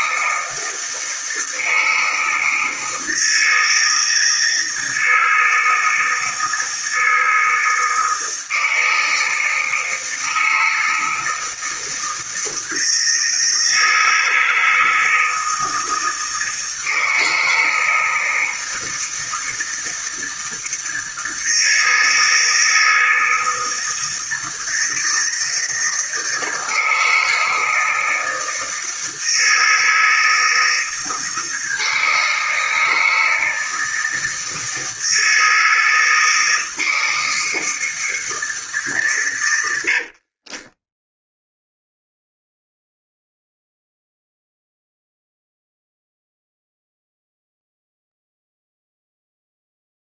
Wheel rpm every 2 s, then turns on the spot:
160, 160, 160, 160, 160, 160, 160, 160, 160, 160, 160, 160, 160, 160, 160, 160, 160, 160, 160, 150, 20, 0, 0, 0, 0.
40-42